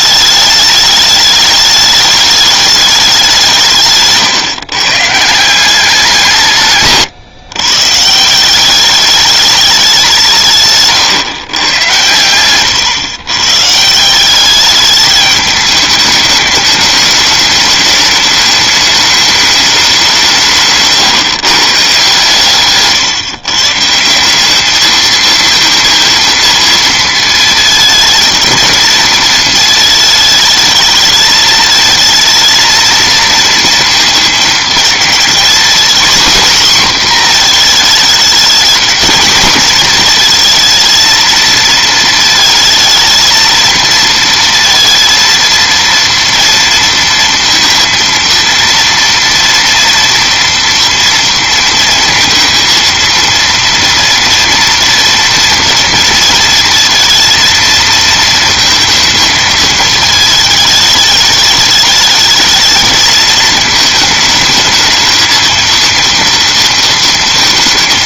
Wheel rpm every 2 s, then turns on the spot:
210, 210, 140, 150, 190, 140, 120, 200, 210, 210, 140, 150, 210, 230, 220, 220, 220, 220, 250, 230, 230, 230, 230, 230, 230, 230, 230, 230, 230, 220, 210, 210, 220, 230.
10-12 20-22